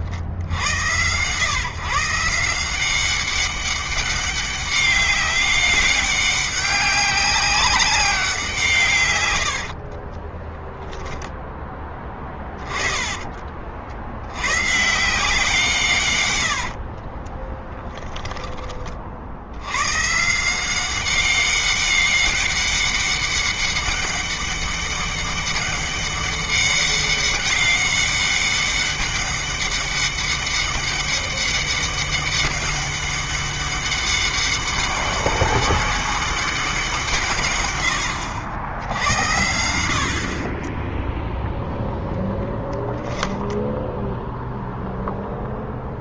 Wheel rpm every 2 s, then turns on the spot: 100, 190, 200, 190, 140, 0, 20, 150, 40, 40, 180, 200, 200, 200, 200, 200, 200, 200, 180, 90, 20, 0, 0.
12-14 16-18